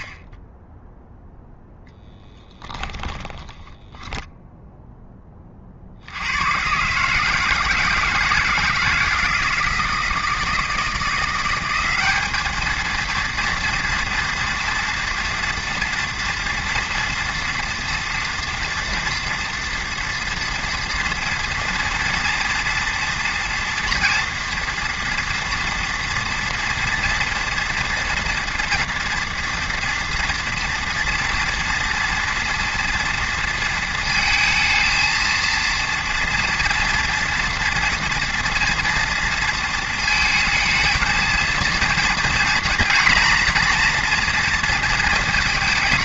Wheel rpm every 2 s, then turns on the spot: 0, 10, 0, 130, 160, 170, 230, 240, 230, 230, 230, 230, 230, 230, 230, 230, 230, 230, 230, 230, 230, 240, 230.
2-4